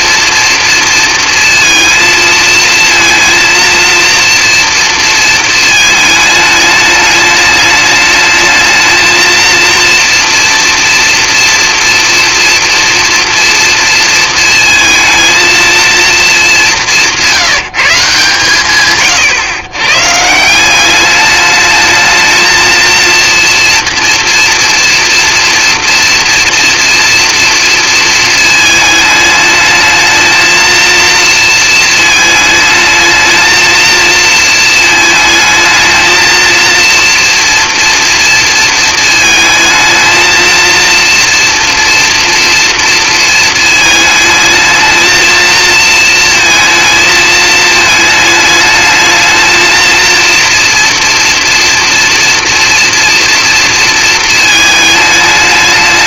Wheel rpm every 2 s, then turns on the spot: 230, 230, 230, 210, 220, 230, 230, 220, 190, 140, 200, 230, 230, 230, 220, 230, 220, 220, 230, 220, 230, 230, 220, 220, 220, 240, 230, 210.
none